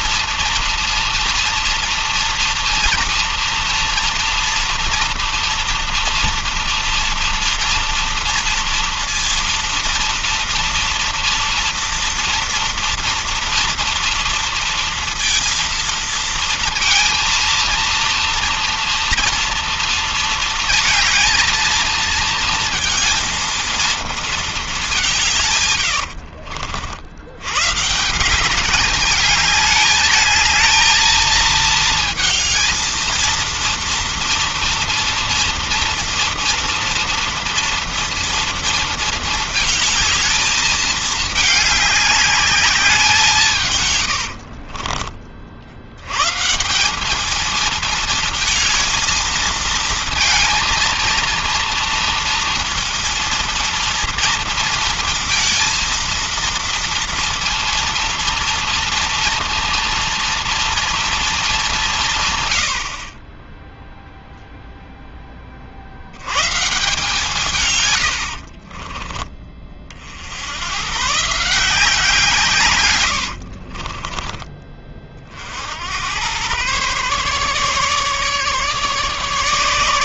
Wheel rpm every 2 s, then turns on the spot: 230, 230, 230, 230, 230, 230, 230, 230, 230, 230, 230, 230, 220, 80, 190, 220, 220, 230, 230, 230, 220, 200, 70, 170, 220, 230, 230, 230, 230, 230, 230, 120, 0, 130, 60, 90, 140, 20, 110, 150.
26-28 44-46 68-70